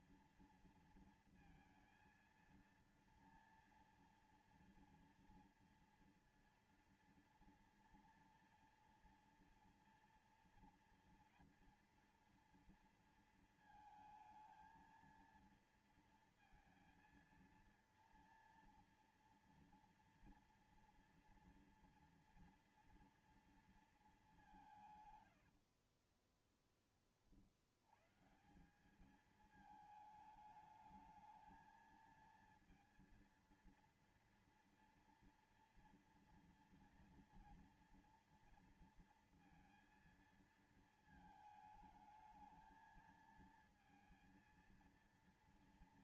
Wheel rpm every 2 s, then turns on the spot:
230, 230, 240, 230, 230, 230, 230, 230, 230, 230, 230, 230, 190, 20, 150, 220, 230, 230, 230, 230, 230, 220, 230.
26-28